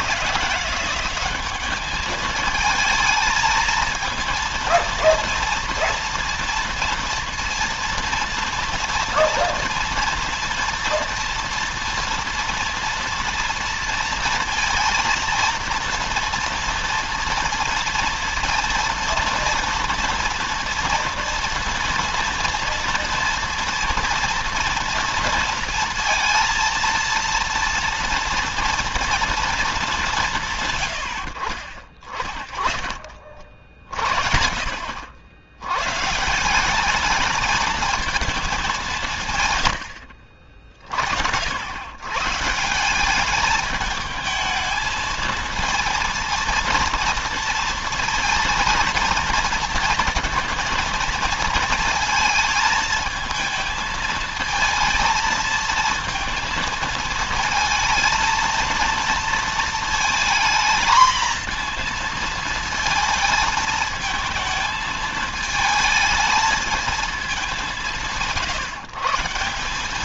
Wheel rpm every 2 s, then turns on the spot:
180, 220, 230, 230, 240, 240, 240, 230, 230, 230, 230, 230, 230, 230, 230, 140, 40, 50, 160, 210, 50, 160, 220, 230, 230, 230, 220, 220, 230, 230, 230, 230, 220, 220, 150.
none